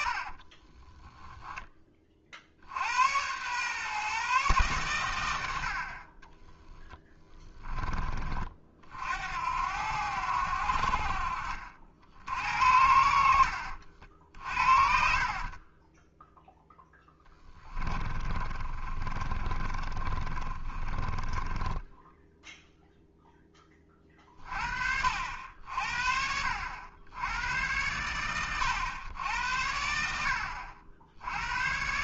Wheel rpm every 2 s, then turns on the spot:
20, 80, 120, 20, 60, 60, 70, 60, 10, 30, 20, 0, 50, 80, 100, 60.
0-2 6-8 14-22